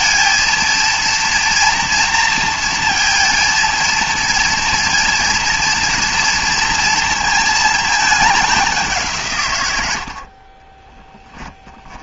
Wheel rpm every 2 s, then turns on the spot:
230, 230, 230, 230, 190, 30.
none